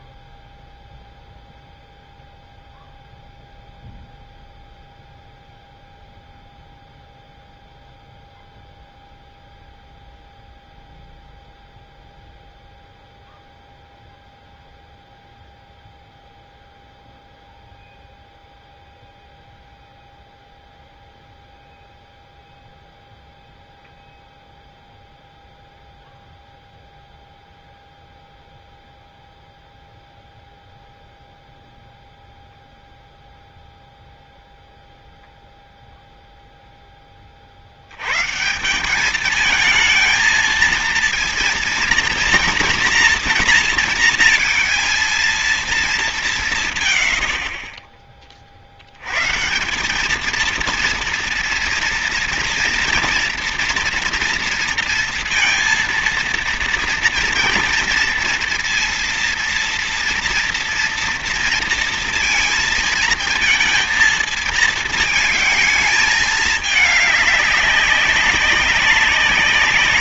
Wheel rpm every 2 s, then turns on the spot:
0, 0, 0, 0, 0, 0, 0, 0, 0, 0, 0, 0, 0, 0, 0, 0, 0, 0, 0, 160, 230, 230, 230, 160, 30, 220, 240, 230, 230, 230, 230, 220, 230, 210, 190.
none